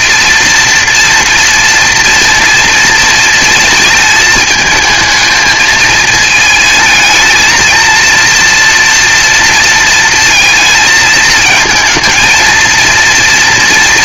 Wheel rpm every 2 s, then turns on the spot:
230, 220, 220, 230, 230, 220, 230.
none